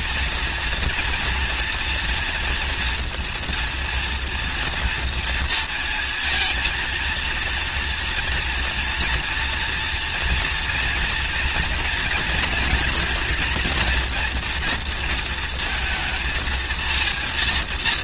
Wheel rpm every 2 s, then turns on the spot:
230, 240, 230, 230, 230, 230, 230, 230, 230.
none